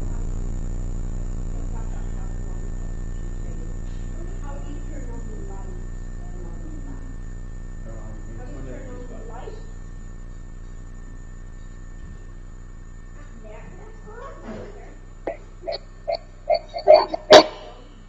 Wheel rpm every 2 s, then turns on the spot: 0, 0, 0, 0, 0, 0, 0, 0, 0.
none